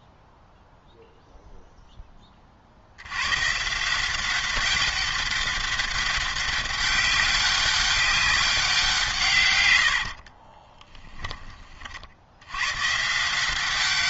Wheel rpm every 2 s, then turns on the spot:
0, 50, 190, 200, 180, 30, 110.
10-12